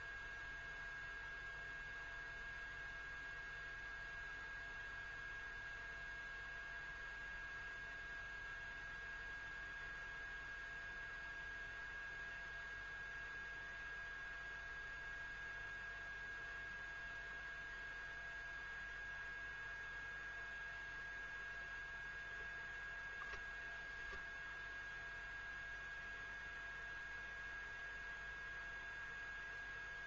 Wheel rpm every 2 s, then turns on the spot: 0, 0, 0, 0, 0, 0, 0, 0, 0, 0, 0, 0, 0, 0, 0.
none